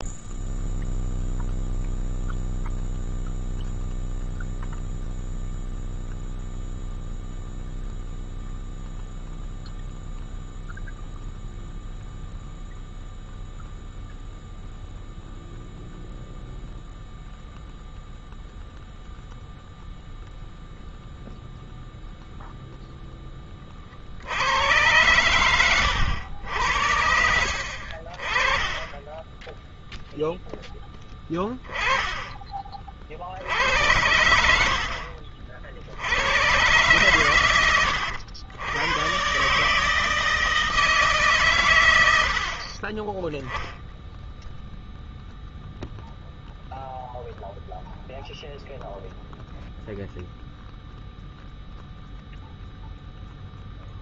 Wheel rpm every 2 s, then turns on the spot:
0, 0, 0, 0, 0, 0, 0, 0, 0, 0, 0, 0, 90, 80, 30, 10, 20, 70, 100, 90, 160, 40, 0, 0, 0, 0, 0.
none